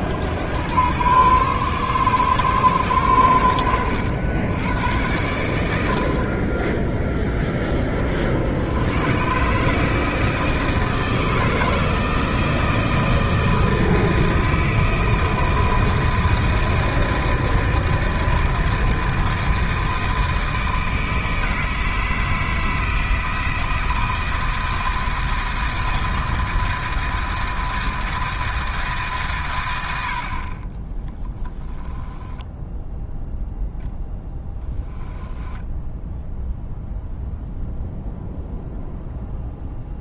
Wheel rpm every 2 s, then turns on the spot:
110, 120, 100, 10, 100, 160, 160, 160, 160, 160, 160, 160, 160, 160, 150, 20, 0, 10, 0, 0.
34-36